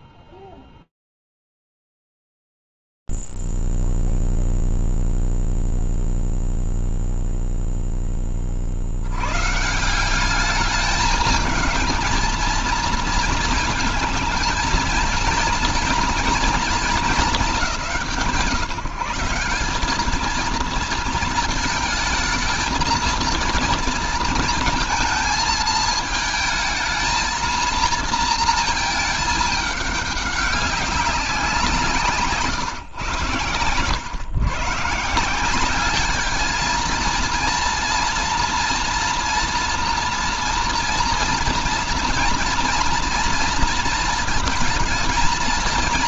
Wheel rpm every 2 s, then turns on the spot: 0, 0, 0, 0, 10, 170, 220, 230, 230, 160, 210, 220, 230, 220, 230, 200, 150, 120, 210, 230, 230, 230, 230.
none